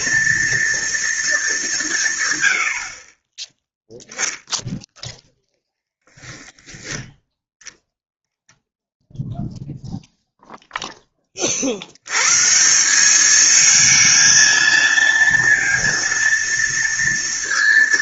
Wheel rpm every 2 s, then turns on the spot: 230, 70, 0, 10, 0, 0, 160, 230, 230.
none